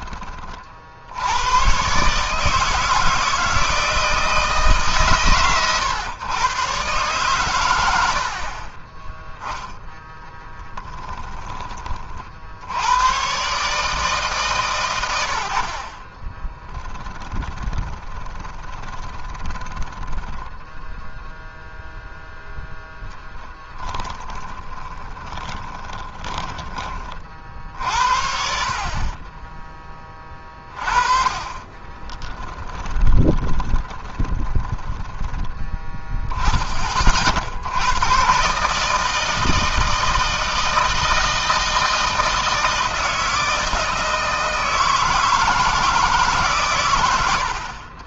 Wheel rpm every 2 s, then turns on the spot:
40, 150, 160, 120, 30, 10, 70, 140, 20, 20, 10, 10, 30, 20, 60, 20, 20, 20, 10, 130, 160, 160, 160, 130.
10-12 16-22 24-28 32-36